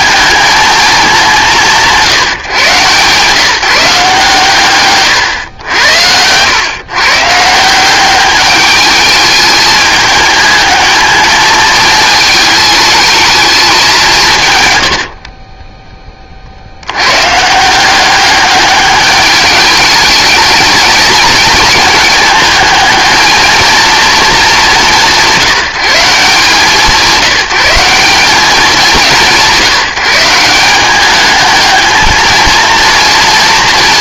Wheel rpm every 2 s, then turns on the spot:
210, 130, 130, 130, 210, 220, 210, 100, 80, 200, 220, 220, 180, 170, 190, 190, 230.
4-6